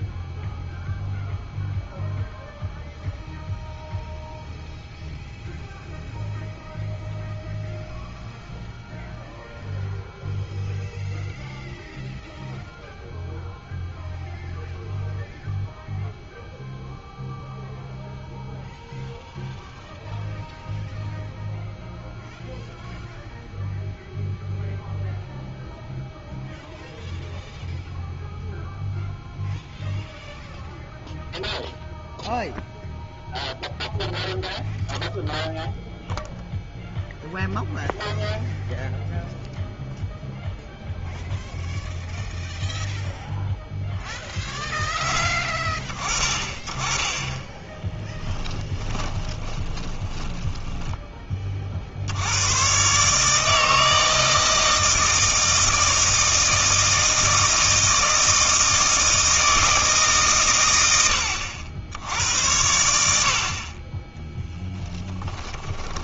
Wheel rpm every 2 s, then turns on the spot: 0, 0, 0, 0, 0, 0, 0, 0, 0, 0, 0, 0, 0, 0, 0, 0, 0, 0, 0, 0, 0, 0, 10, 20, 20, 20, 120, 160, 160, 160, 100, 70, 10.
48-52 64-66